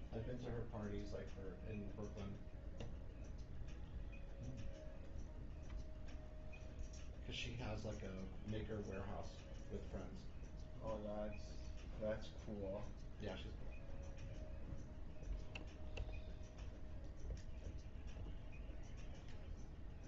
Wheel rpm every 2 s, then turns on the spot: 0, 0, 0, 0, 0, 0, 0, 0, 0, 0.
none